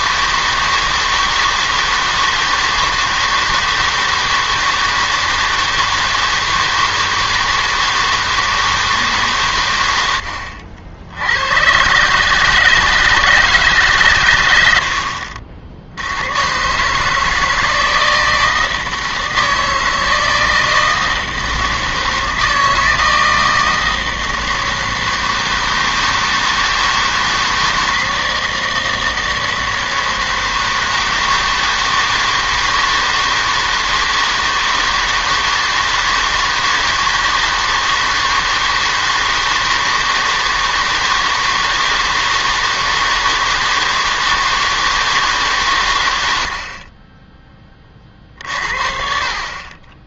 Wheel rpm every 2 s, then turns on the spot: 160, 160, 160, 160, 160, 70, 160, 100, 130, 160, 160, 160, 160, 160, 160, 160, 160, 160, 160, 160, 160, 160, 160, 60, 60.
none